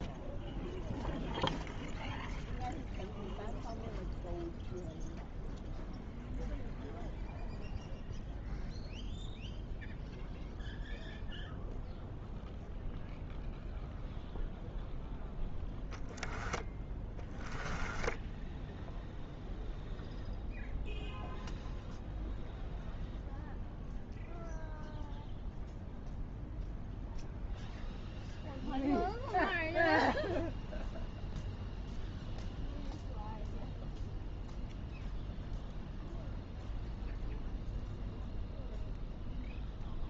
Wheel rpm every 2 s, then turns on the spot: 0, 0, 0, 0, 0, 0, 0, 0, 10, 0, 0, 0, 0, 0, 0, 0, 0, 0, 0, 0.
16-18